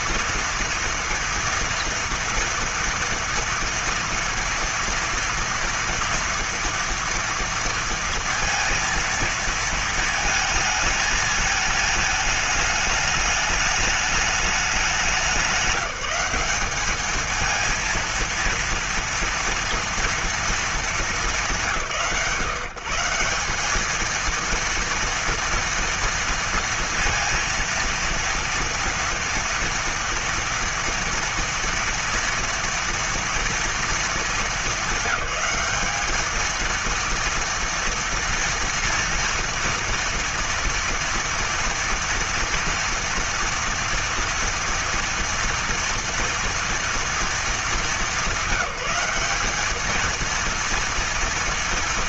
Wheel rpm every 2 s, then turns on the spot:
230, 230, 230, 230, 230, 220, 210, 200, 200, 230, 230, 140, 230, 230, 230, 230, 230, 220, 230, 230, 230, 240, 230, 230, 190, 230.
none